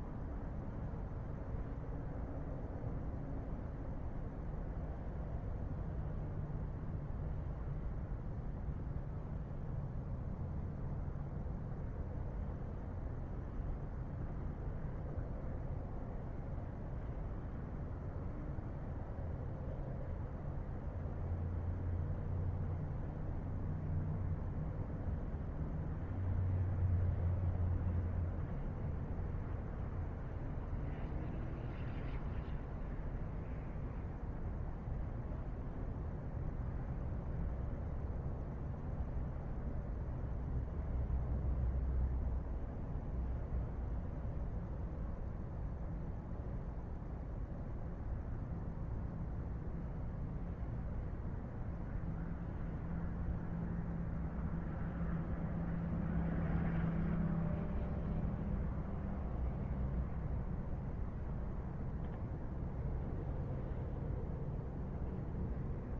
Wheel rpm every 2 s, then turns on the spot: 0, 0, 0, 0, 0, 0, 0, 0, 0, 0, 0, 0, 0, 0, 0, 0, 0, 0, 0, 0, 0, 0, 0, 0, 0, 0, 0, 0, 0, 0, 0, 0, 0.
none